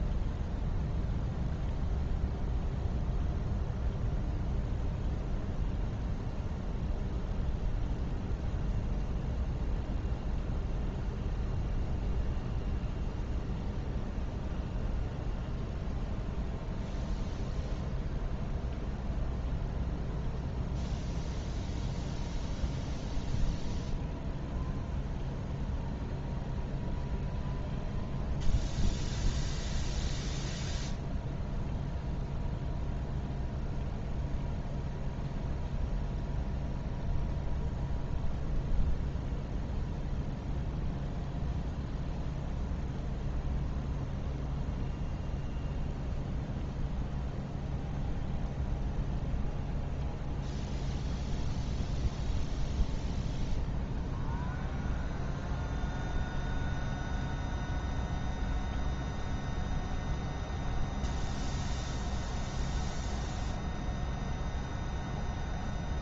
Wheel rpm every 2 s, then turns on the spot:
0, 0, 0, 0, 0, 0, 0, 0, 0, 0, 0, 0, 0, 0, 0, 0, 0, 0, 0, 0, 0, 0, 0, 0, 0, 0, 0, 0, 0, 0, 0, 0, 0.
none